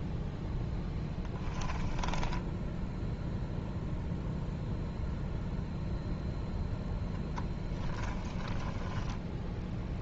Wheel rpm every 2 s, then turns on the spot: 10, 0, 0, 0, 10.
0-2